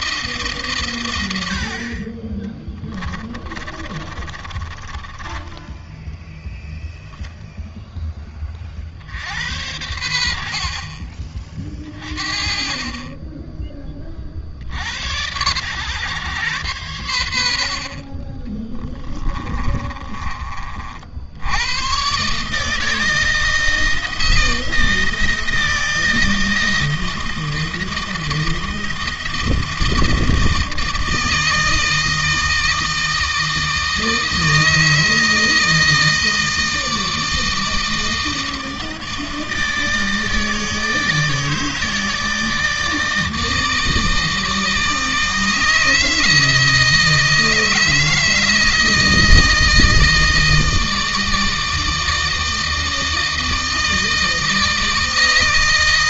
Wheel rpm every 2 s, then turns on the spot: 130, 20, 30, 0, 40, 50, 30, 60, 120, 30, 40, 150, 170, 160, 160, 160, 160, 160, 160, 160, 160, 160, 160, 160, 160, 160, 160, 160.
2-6 18-20